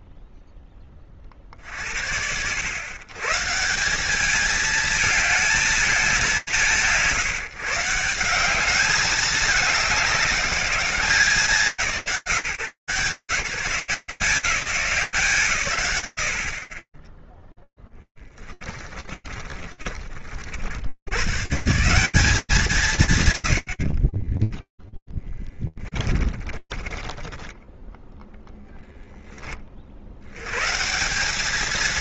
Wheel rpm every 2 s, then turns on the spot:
0, 110, 210, 150, 210, 190, 150, 180, 50, 20, 70, 160, 10, 20, 20, 170.
18-20 24-30